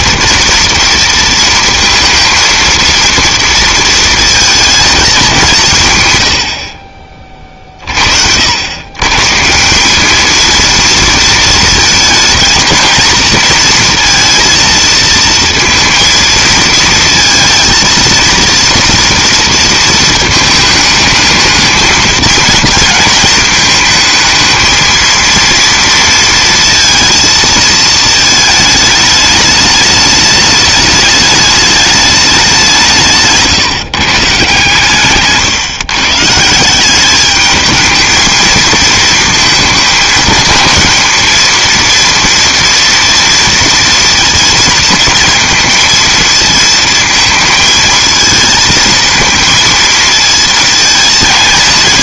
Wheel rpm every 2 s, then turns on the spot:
230, 230, 230, 60, 80, 230, 230, 230, 230, 230, 220, 220, 220, 230, 220, 210, 190, 150, 160, 220, 220, 230, 230, 220, 220, 220.
none